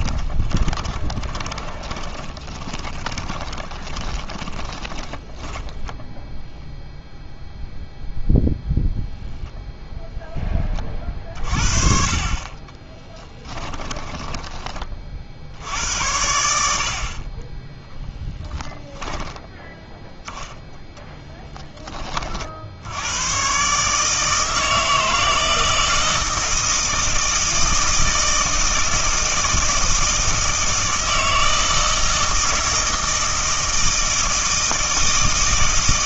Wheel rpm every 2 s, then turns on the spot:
20, 20, 20, 0, 0, 20, 20, 20, 70, 10, 10, 70, 160, 160, 160, 160, 160, 160.
0-6 12-14